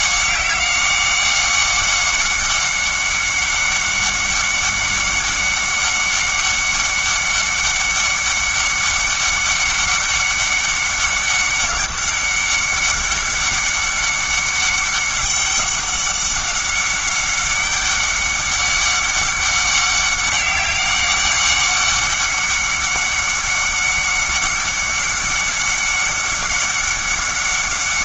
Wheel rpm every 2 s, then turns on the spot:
190, 190, 190, 190, 200, 200, 200, 200, 200, 200, 190, 190, 200, 200.
none